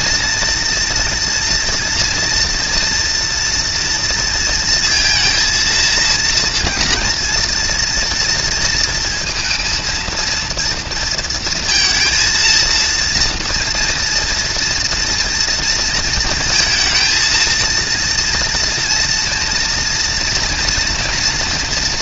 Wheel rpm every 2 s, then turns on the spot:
230, 230, 230, 230, 230, 230, 230, 230, 220, 230, 240.
none